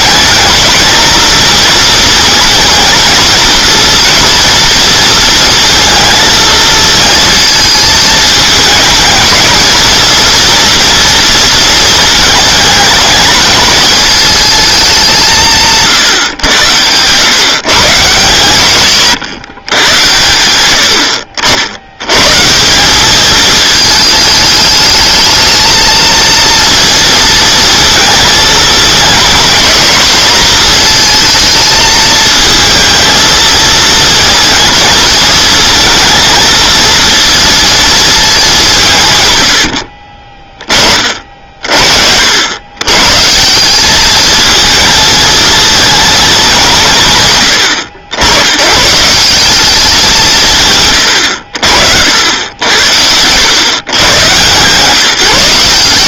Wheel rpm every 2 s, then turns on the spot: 220, 230, 230, 220, 220, 230, 220, 210, 120, 130, 90, 180, 210, 230, 220, 220, 220, 230, 230, 180, 30, 100, 220, 190, 110, 150, 80, 140.
16-18